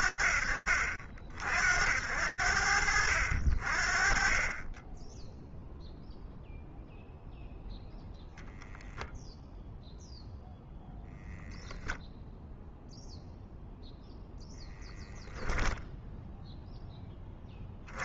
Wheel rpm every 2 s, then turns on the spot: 50, 60, 0, 0, 0, 0, 0, 0, 50.
none